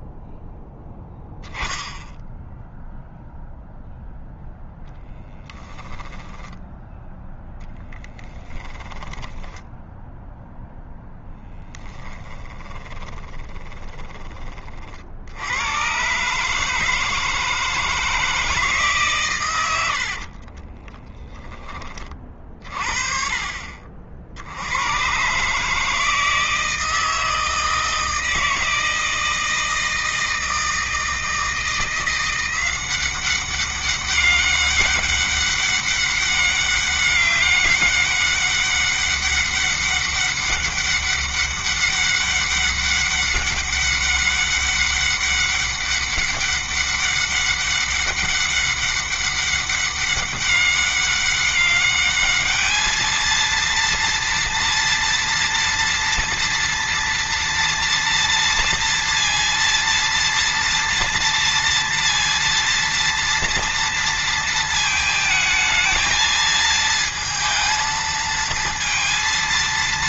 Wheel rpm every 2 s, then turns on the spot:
0, 0, 0, 10, 10, 0, 20, 40, 150, 150, 20, 50, 100, 160, 160, 160, 180, 200, 200, 200, 200, 200, 200, 200, 200, 200, 220, 230, 230, 230, 230, 230, 220, 220, 230.
8-10 12-14 20-22